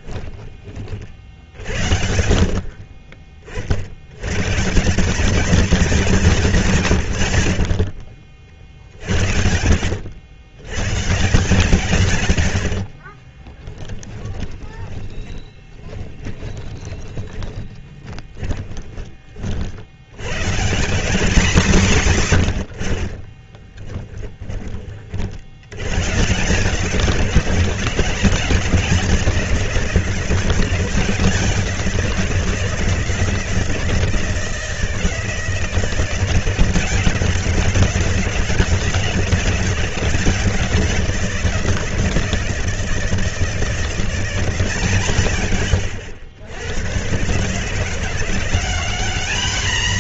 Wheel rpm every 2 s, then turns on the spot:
20, 50, 130, 160, 60, 110, 70, 20, 30, 20, 140, 90, 20, 160, 170, 170, 170, 160, 170, 180, 180, 160, 160, 100, 190.
8-10 12-20